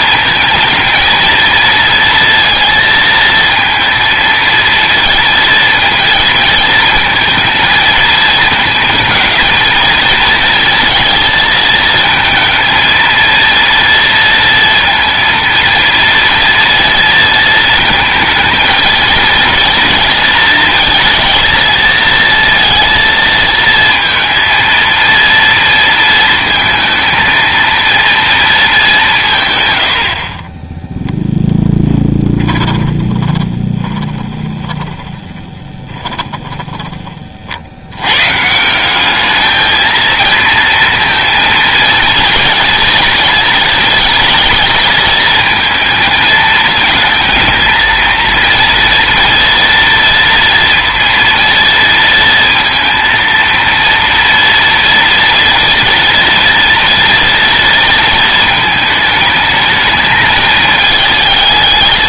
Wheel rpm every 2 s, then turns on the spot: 220, 230, 230, 230, 220, 220, 220, 230, 230, 230, 230, 230, 230, 230, 230, 60, 10, 20, 10, 150, 230, 230, 230, 220, 230, 230, 230, 230, 230, 220, 220.
32-38